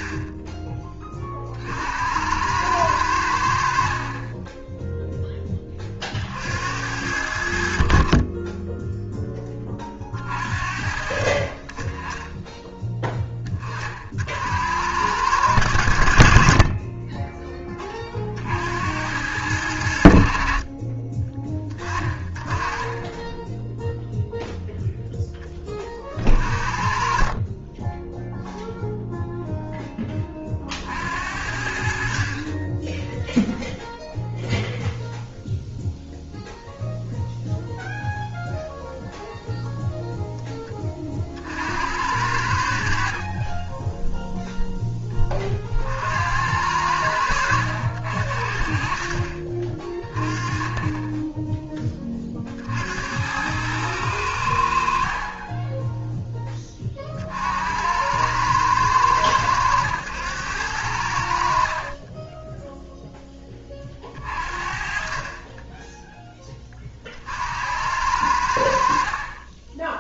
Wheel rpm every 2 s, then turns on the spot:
20, 100, 10, 70, 10, 50, 10, 80, 30, 60, 50, 30, 0, 40, 0, 50, 20, 0, 0, 0, 20, 60, 0, 90, 50, 20, 60, 60, 30, 110, 90, 10, 40, 30, 70.
none